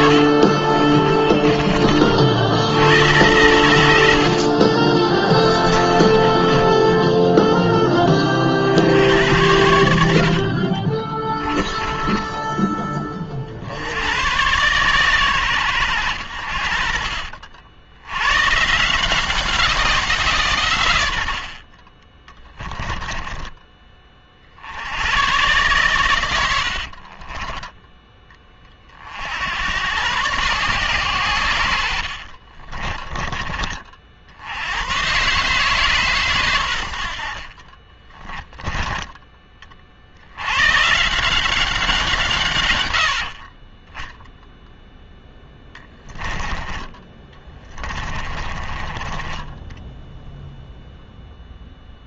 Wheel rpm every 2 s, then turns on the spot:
40, 100, 30, 10, 70, 40, 20, 130, 50, 160, 100, 10, 90, 50, 40, 120, 30, 110, 90, 20, 150, 100, 0, 30, 30, 0.
0-2 4-8 10-12 22-24 26-28 32-34 38-40 46-50